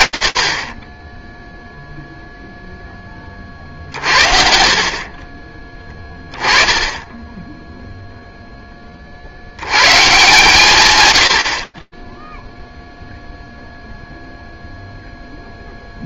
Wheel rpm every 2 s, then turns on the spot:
40, 0, 40, 10, 40, 110, 0, 0.
none